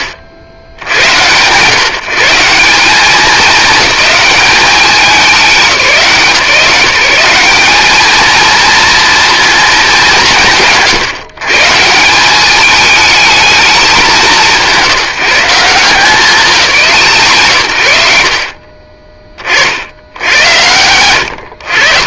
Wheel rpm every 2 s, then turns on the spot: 100, 190, 200, 170, 230, 130, 220, 170, 170, 50, 90.
none